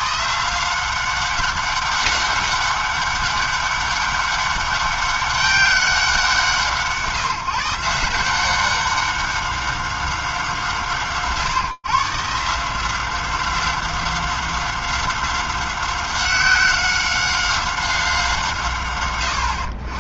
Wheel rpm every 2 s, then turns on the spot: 110, 200, 200, 190, 170, 190, 150, 190, 190, 190.
none